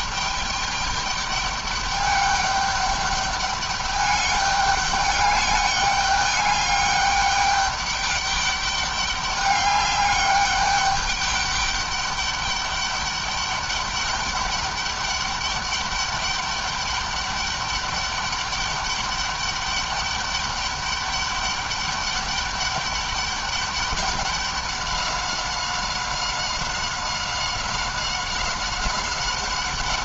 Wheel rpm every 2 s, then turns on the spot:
210, 200, 200, 200, 200, 200, 200, 200, 200, 200, 200, 200, 200, 190, 190.
none